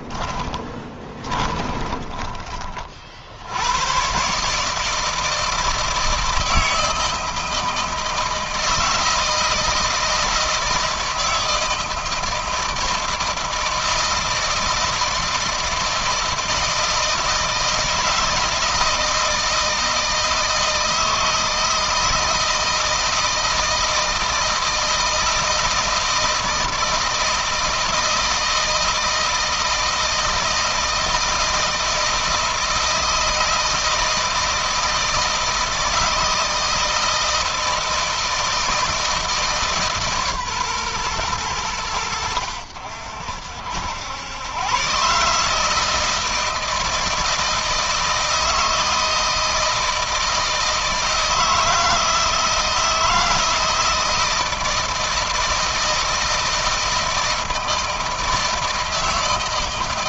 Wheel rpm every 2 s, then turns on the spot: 20, 50, 160, 160, 160, 160, 160, 160, 160, 160, 160, 160, 160, 160, 160, 160, 160, 160, 160, 160, 130, 70, 130, 160, 160, 160, 160, 160, 160, 160.
0-2